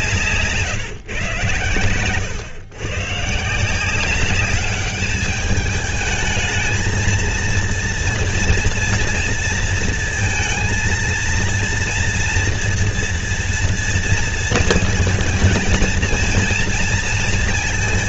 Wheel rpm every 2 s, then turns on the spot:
140, 120, 200, 220, 230, 230, 240, 230, 230.
none